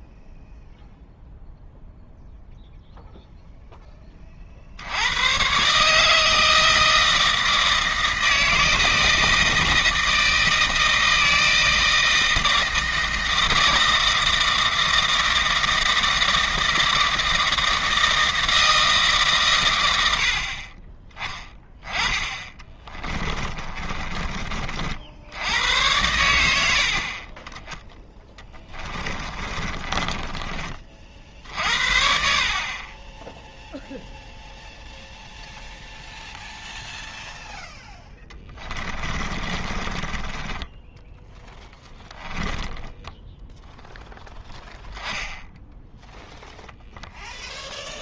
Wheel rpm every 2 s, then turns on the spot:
0, 0, 80, 160, 160, 160, 160, 160, 160, 160, 20, 20, 60, 60, 20, 40, 30, 0, 0, 20, 10, 10, 0, 0.
20-24 28-30 32-34 38-44